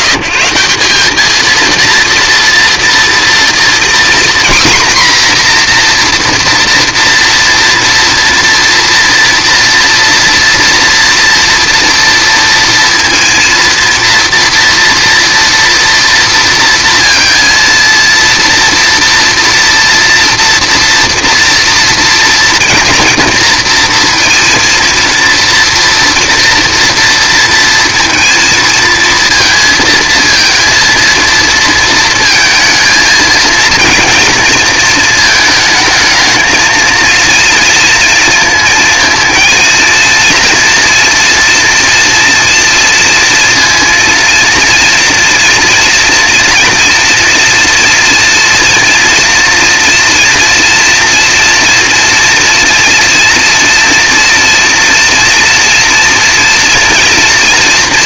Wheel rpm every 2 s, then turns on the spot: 160, 230, 250, 230, 230, 230, 230, 230, 230, 230, 230, 230, 230, 230, 230, 230, 230, 230, 220, 230, 230, 230, 230, 240, 240, 230, 240, 240, 230.
none